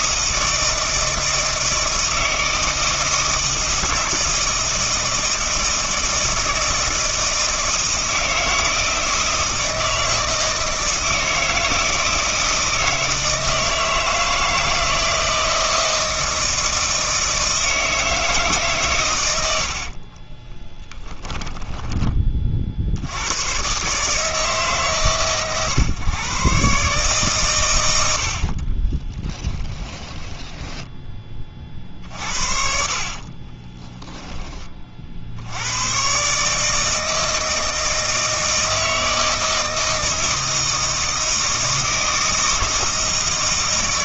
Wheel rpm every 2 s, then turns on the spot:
160, 160, 160, 160, 160, 160, 160, 160, 160, 140, 10, 60, 140, 140, 60, 10, 50, 30, 160, 160, 160, 160.
20-22 28-32